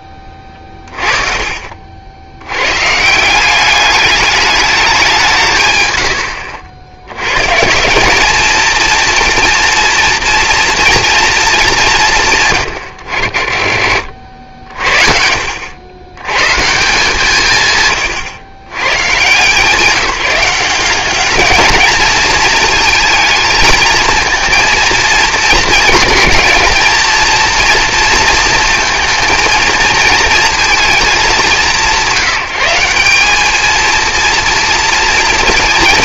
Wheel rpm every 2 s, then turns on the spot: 30, 120, 200, 80, 230, 230, 130, 60, 150, 120, 190, 220, 230, 230, 220, 220, 180, 230.
0-2